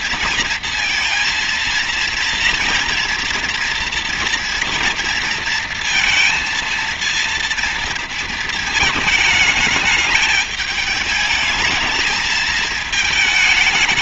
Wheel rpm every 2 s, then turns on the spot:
230, 230, 230, 230, 220, 210, 220.
none